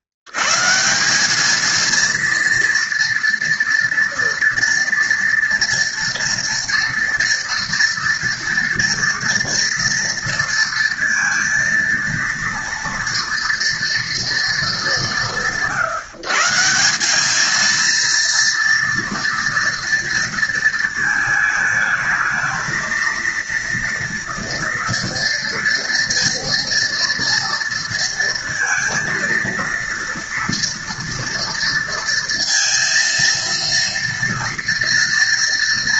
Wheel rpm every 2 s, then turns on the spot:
100, 230, 230, 230, 230, 230, 230, 230, 160, 230, 230, 220, 240, 240, 230, 230, 230, 230.
none